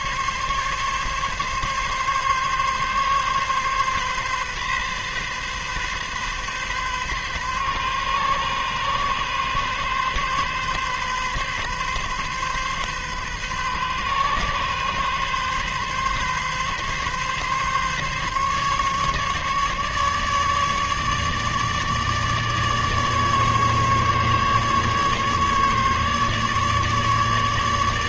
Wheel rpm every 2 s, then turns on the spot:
140, 140, 140, 130, 130, 130, 130, 130, 130, 140, 150, 150, 140, 150.
none